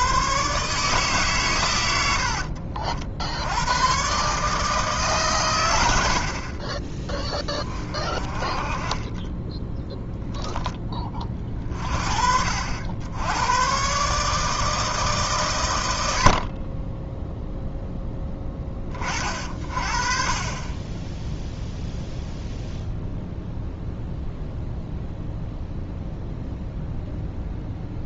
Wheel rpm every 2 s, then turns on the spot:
140, 60, 150, 30, 30, 10, 60, 160, 40, 20, 20, 0, 0, 0.
none